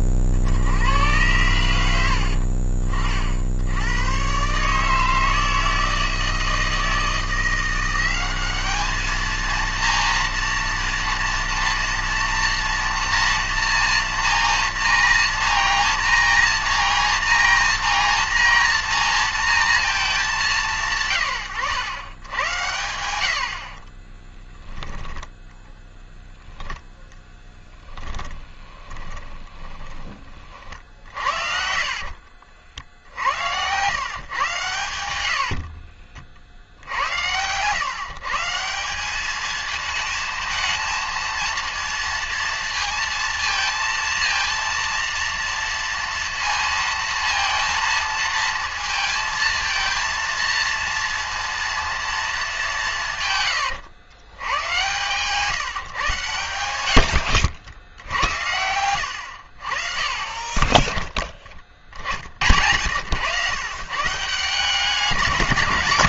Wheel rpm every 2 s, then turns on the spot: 70, 50, 140, 160, 200, 230, 230, 230, 230, 230, 180, 100, 10, 0, 20, 40, 60, 120, 60, 160, 220, 230, 230, 230, 230, 230, 210, 110, 100, 80, 30, 80, 170.
24-26 28-32 54-56